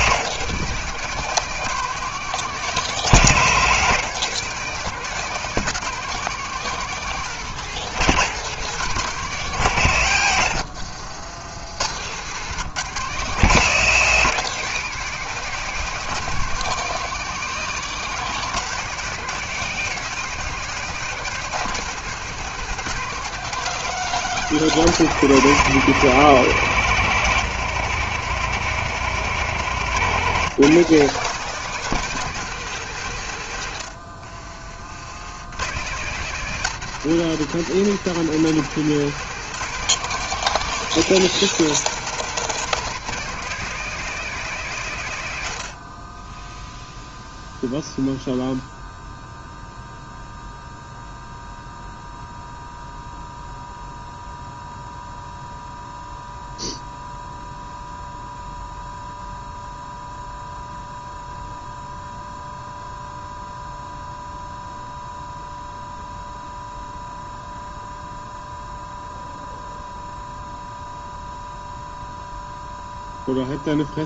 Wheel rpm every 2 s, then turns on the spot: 170, 170, 170, 180, 160, 70, 150, 170, 180, 170, 170, 170, 160, 160, 160, 170, 120, 70, 160, 160, 180, 170, 100, 0, 0, 0, 0, 0, 0, 0, 0, 0, 0, 0, 0, 0, 0.
none